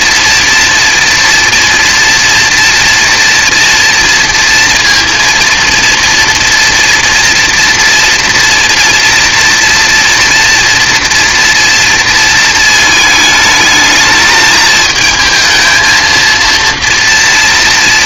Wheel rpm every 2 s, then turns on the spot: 230, 230, 230, 240, 240, 230, 220, 220, 230.
none